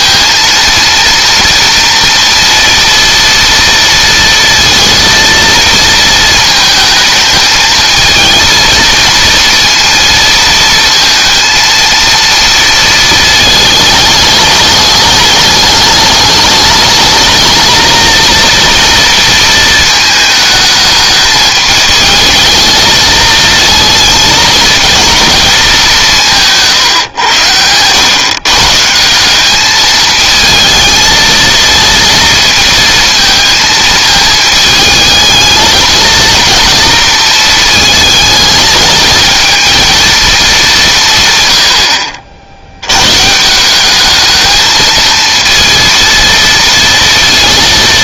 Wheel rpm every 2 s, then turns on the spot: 230, 230, 230, 220, 230, 230, 230, 210, 220, 230, 220, 220, 230, 140, 160, 220, 230, 220, 230, 220, 190, 110, 220, 230.
none